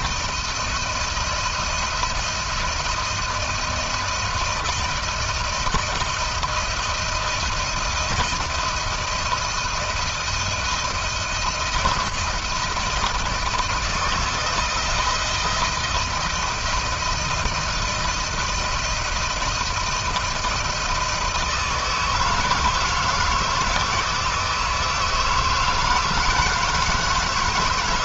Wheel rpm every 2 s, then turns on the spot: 160, 170, 160, 160, 160, 170, 160, 160, 160, 160, 160, 160, 160, 160.
none